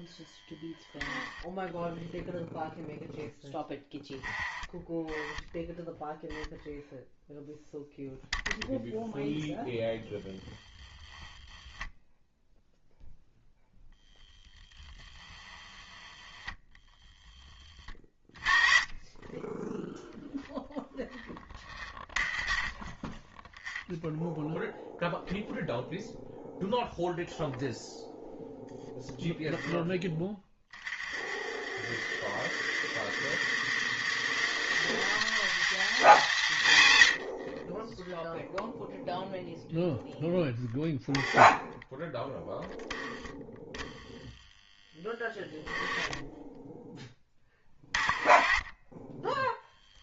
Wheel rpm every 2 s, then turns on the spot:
10, 0, 10, 0, 10, 20, 0, 0, 10, 20, 0, 20, 0, 0, 0, 30, 110, 200, 110, 0, 10, 10, 10, 10, 20.
0-2 10-12 16-18